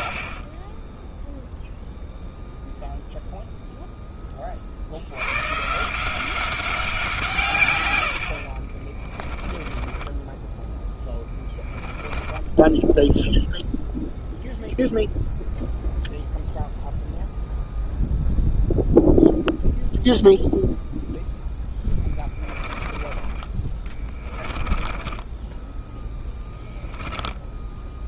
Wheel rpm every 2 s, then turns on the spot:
10, 0, 60, 180, 50, 10, 10, 0, 0, 0, 0, 20, 20, 10.
8-14 24-28